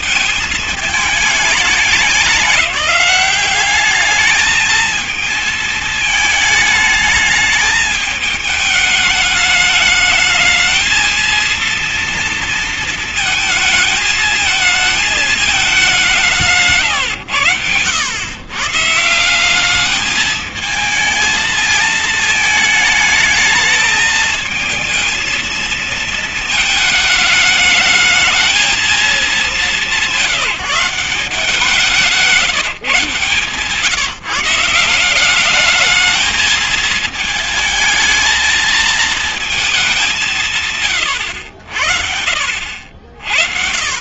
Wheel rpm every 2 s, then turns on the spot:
220, 200, 220, 220, 210, 220, 230, 220, 150, 120, 220, 220, 220, 220, 230, 180, 180, 170, 220, 220, 160, 60.
none